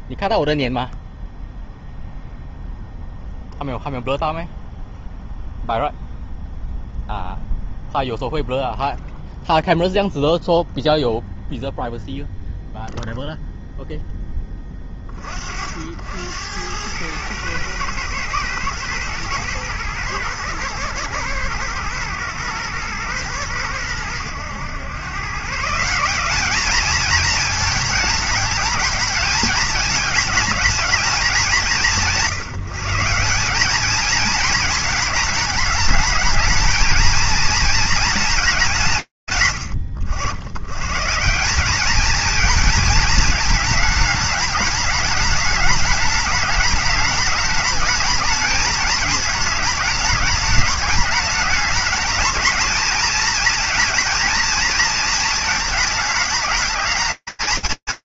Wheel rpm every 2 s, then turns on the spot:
0, 0, 0, 0, 0, 0, 0, 20, 100, 110, 110, 110, 110, 220, 210, 210, 170, 220, 230, 180, 90, 230, 210, 210, 220, 210, 220, 230, 220.
none